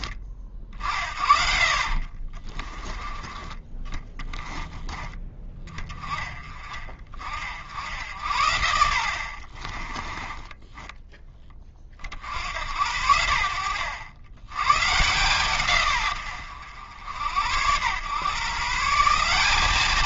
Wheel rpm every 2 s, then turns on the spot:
50, 20, 20, 40, 80, 10, 80, 120, 90, 160.
10-12